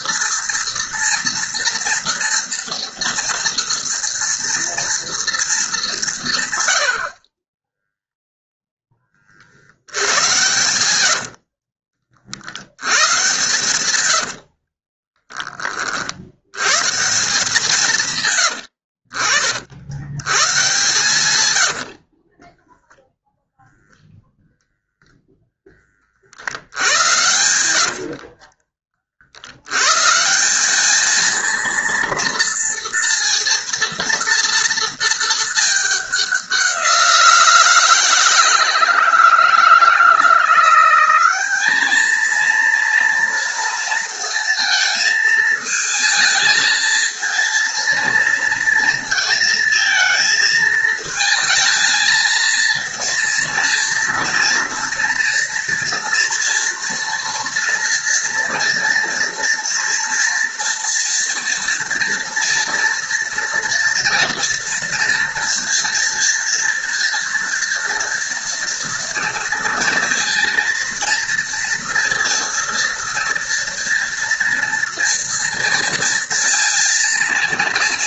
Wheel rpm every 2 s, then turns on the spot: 230, 230, 230, 80, 10, 120, 100, 40, 140, 80, 130, 10, 0, 90, 40, 210, 230, 230, 180, 160, 180, 230, 220, 230, 230, 220, 230, 230, 240, 230, 230, 230, 230, 230, 230, 230, 230, 230, 230.
10-12 14-16 18-20